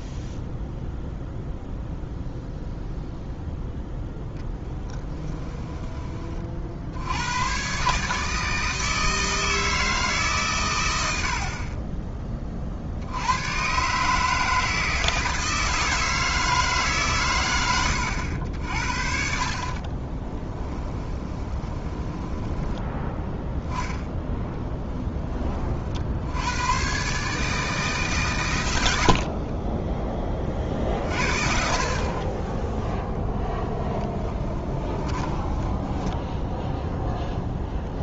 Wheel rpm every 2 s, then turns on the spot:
0, 0, 10, 50, 160, 120, 40, 160, 150, 60, 10, 10, 10, 110, 110, 40, 10, 20, 0.
4-6 20-22 34-36